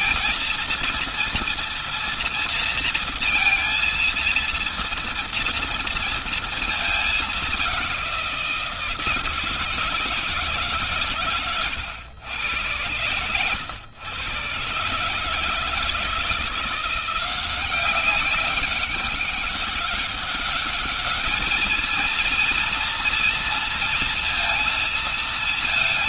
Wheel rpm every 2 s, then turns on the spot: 230, 230, 230, 230, 180, 150, 110, 130, 170, 200, 200, 230, 230.
none